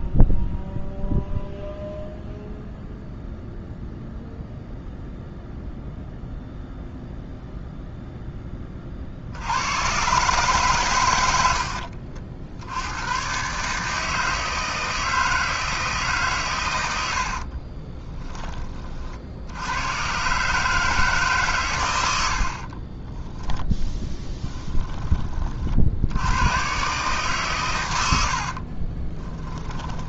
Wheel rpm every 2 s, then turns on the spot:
0, 0, 0, 0, 40, 130, 90, 160, 90, 30, 150, 50, 10, 120, 40.
22-24 28-30